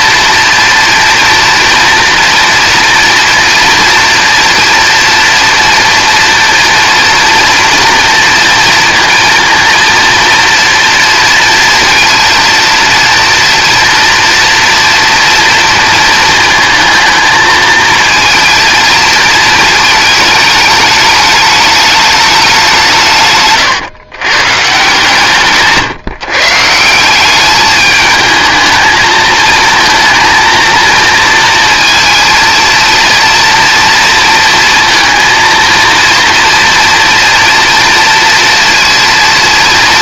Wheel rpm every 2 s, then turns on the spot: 230, 230, 230, 230, 230, 230, 230, 230, 220, 230, 210, 150, 140, 170, 220, 230, 230, 230, 230, 230.
none